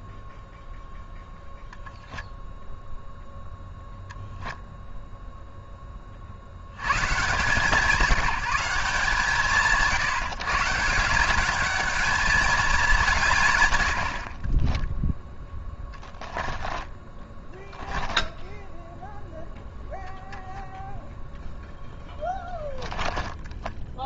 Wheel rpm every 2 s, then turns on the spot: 0, 0, 10, 90, 150, 180, 200, 20, 10, 0, 0, 10.
14-18 22-24